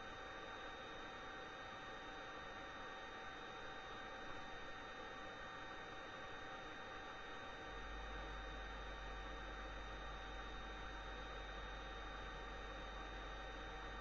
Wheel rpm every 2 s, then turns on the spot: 0, 0, 0, 0, 0, 0, 0.
none